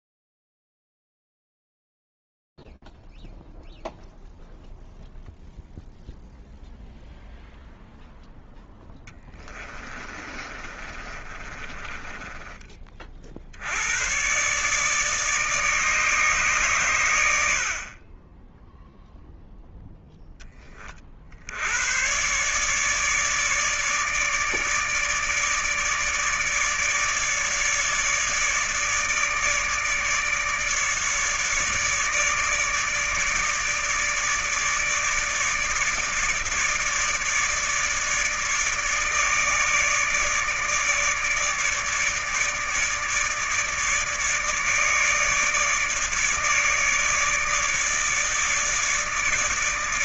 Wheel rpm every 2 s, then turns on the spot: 0, 0, 0, 0, 0, 30, 30, 120, 140, 10, 30, 140, 150, 150, 150, 150, 150, 150, 150, 150, 150, 150, 150, 150, 150.
10-12